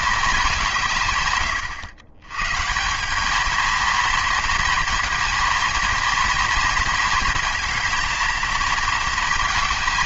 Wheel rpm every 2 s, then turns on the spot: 170, 160, 230, 230, 230.
none